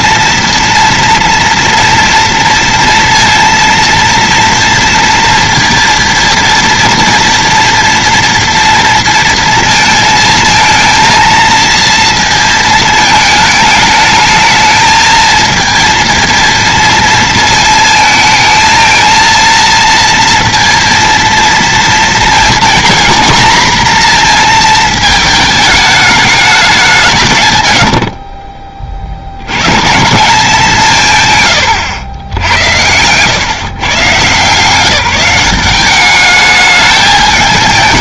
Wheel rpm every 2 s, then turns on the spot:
230, 230, 230, 230, 230, 220, 220, 220, 230, 230, 230, 240, 220, 190, 30, 180, 90, 180, 210.
none